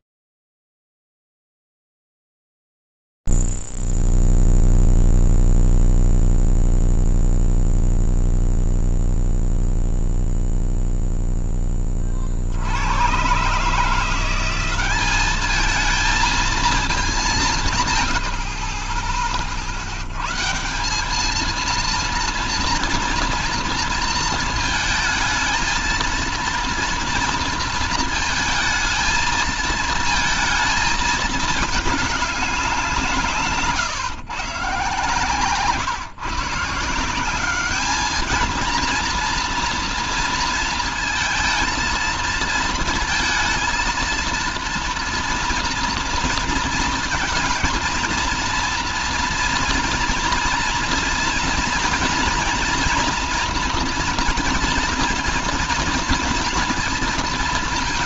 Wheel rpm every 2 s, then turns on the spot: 0, 0, 0, 0, 0, 0, 30, 170, 220, 120, 90, 230, 230, 220, 220, 220, 210, 140, 160, 220, 230, 230, 230, 230, 230, 230, 240, 240, 230.
none